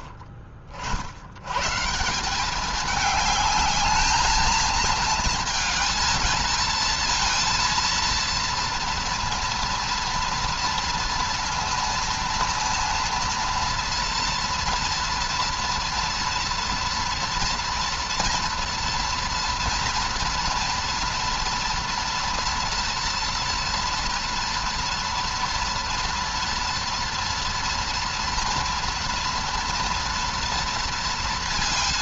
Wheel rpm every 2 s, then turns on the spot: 70, 200, 220, 220, 230, 230, 230, 230, 230, 230, 230, 240, 240, 230, 230, 230.
none